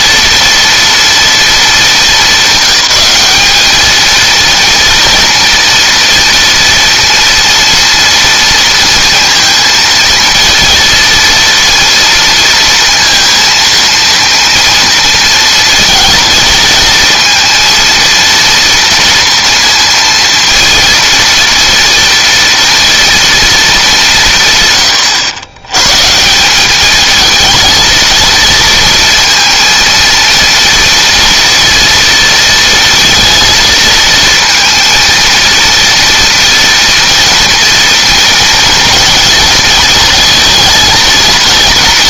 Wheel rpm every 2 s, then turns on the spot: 230, 200, 230, 230, 230, 230, 230, 230, 230, 230, 230, 230, 100, 210, 230, 230, 230, 230, 230, 230, 220.
none